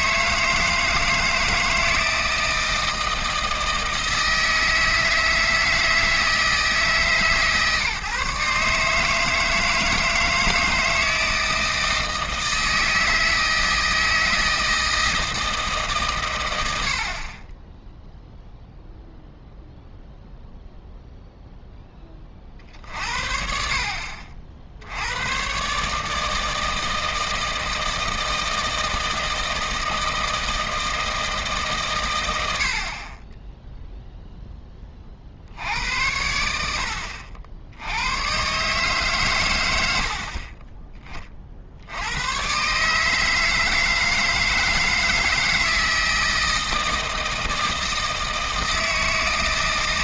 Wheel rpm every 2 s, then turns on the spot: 170, 160, 160, 160, 150, 160, 160, 160, 70, 0, 0, 50, 60, 160, 160, 160, 80, 10, 80, 140, 30, 130, 160, 160, 160.
none